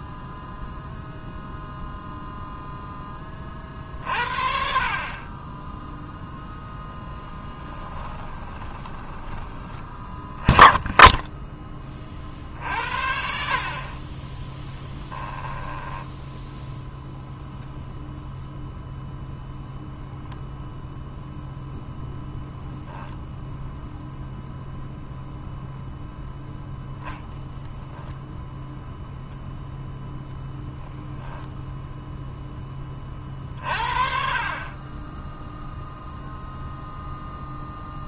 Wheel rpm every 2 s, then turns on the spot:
0, 0, 40, 10, 20, 10, 60, 10, 0, 0, 0, 0, 0, 0, 0, 10, 10, 40, 0.
6-10 14-16 30-32